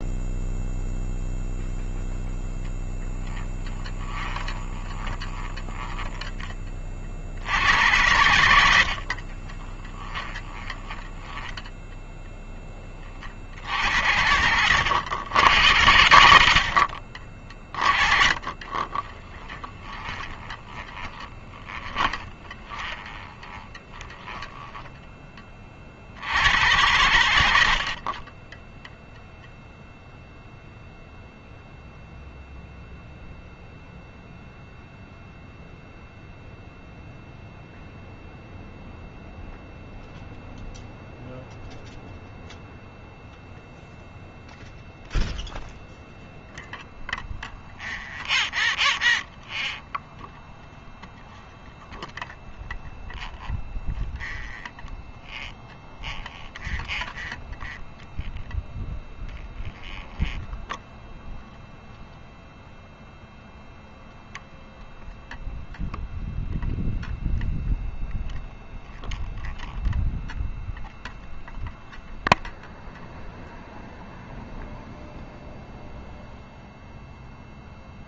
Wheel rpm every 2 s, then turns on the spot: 0, 20, 20, 60, 50, 10, 60, 100, 40, 20, 20, 20, 20, 80, 0, 0, 0, 0, 0, 0, 0, 0, 0, 0, 0, 0, 0, 0, 0, 0, 0, 0, 0, 0, 0, 0, 0, 0, 0.
2-6 8-12 16-24 26-28